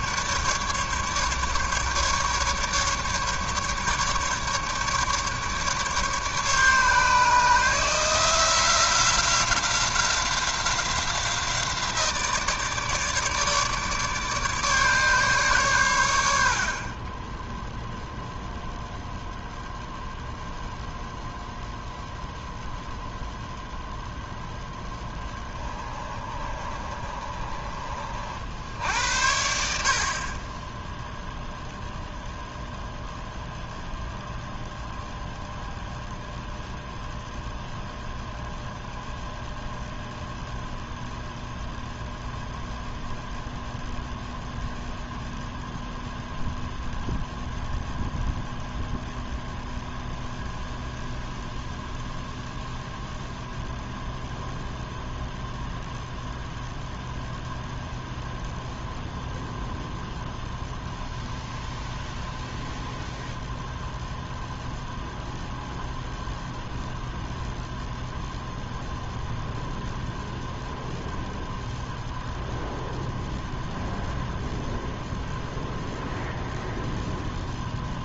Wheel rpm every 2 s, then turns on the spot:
150, 140, 150, 150, 180, 180, 150, 150, 30, 0, 0, 0, 10, 30, 80, 0, 0, 0, 0, 0, 0, 0, 0, 0, 0, 0, 0, 0, 0, 0, 0, 0, 0, 0, 0, 0, 0, 0, 0.
16-18 24-28